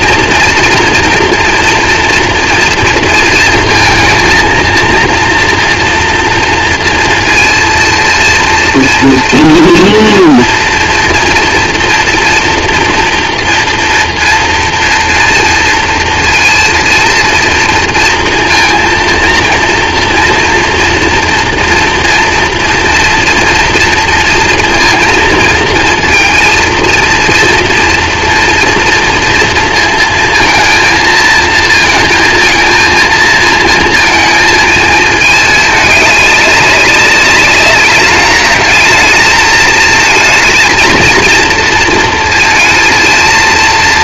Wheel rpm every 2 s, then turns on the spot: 230, 230, 230, 230, 230, 240, 230, 230, 230, 230, 230, 230, 230, 230, 230, 230, 230, 220, 200, 210, 220, 230.
none